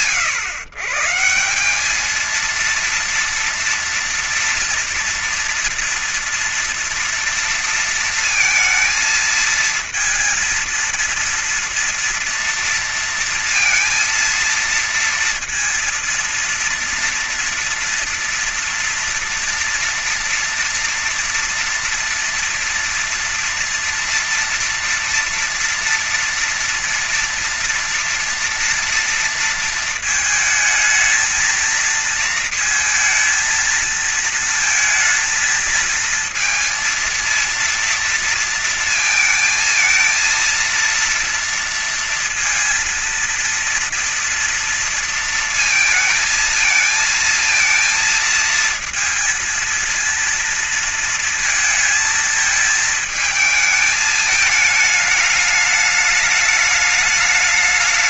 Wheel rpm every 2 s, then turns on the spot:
130, 220, 230, 230, 220, 230, 230, 230, 230, 230, 230, 230, 230, 230, 240, 220, 230, 220, 220, 230, 230, 230, 230, 220, 230, 230, 220, 210, 210.
none